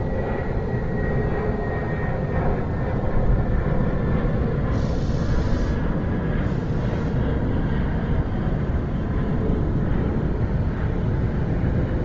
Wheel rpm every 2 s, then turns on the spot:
0, 0, 0, 0, 0, 0.
none